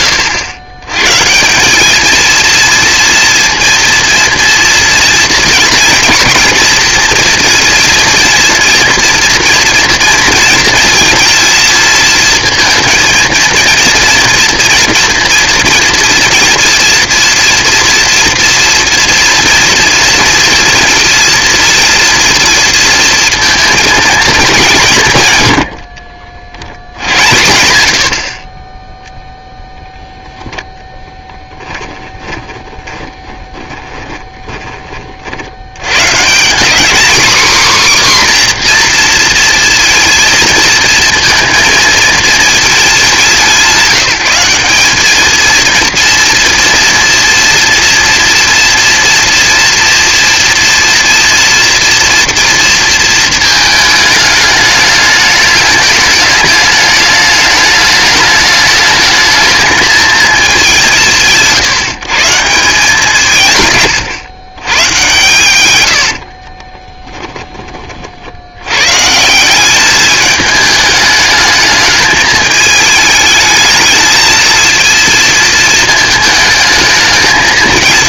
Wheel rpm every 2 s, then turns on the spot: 110, 230, 230, 230, 230, 230, 220, 230, 230, 240, 230, 220, 130, 80, 10, 10, 20, 30, 230, 240, 230, 220, 200, 230, 230, 240, 230, 210, 210, 220, 170, 170, 120, 20, 100, 210, 210, 220, 220.
32-34 66-68